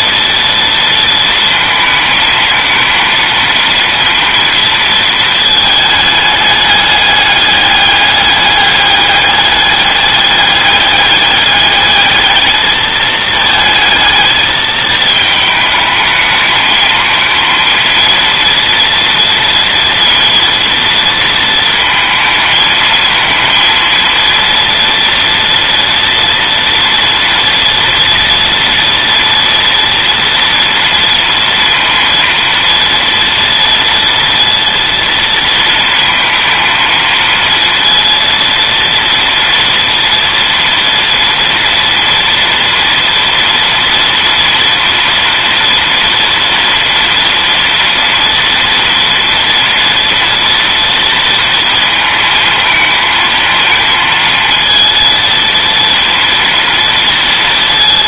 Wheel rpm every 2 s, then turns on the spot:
230, 220, 230, 210, 200, 210, 220, 220, 220, 230, 230, 220, 230, 230, 240, 230, 230, 230, 230, 230, 230, 230, 230, 230, 230, 230, 220, 230, 230.
none